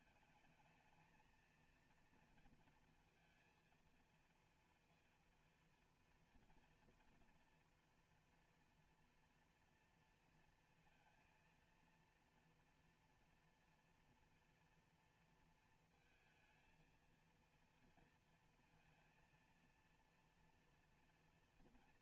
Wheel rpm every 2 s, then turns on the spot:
220, 230, 230, 240, 230, 230, 230, 230, 220, 230, 230.
none